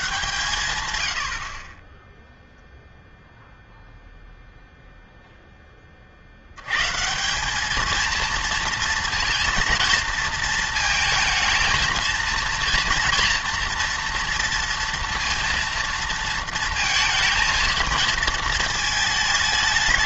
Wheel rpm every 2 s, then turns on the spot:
130, 0, 0, 100, 230, 230, 230, 230, 230, 220.
none